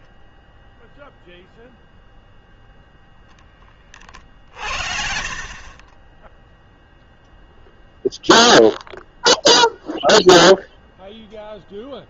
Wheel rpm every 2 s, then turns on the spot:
0, 0, 60, 0, 0, 0.
4-6